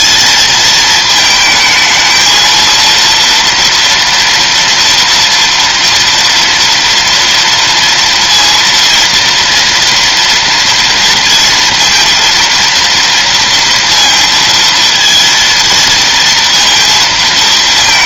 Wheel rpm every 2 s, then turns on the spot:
220, 230, 230, 230, 230, 230, 230, 230, 230.
none